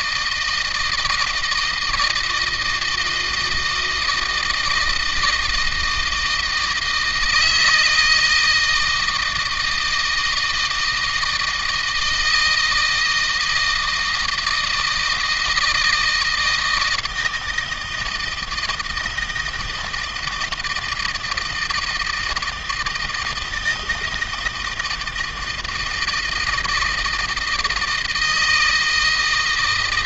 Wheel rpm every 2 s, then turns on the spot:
160, 170, 160, 160, 160, 160, 160, 160, 160, 160, 160, 160, 160, 160, 160.
none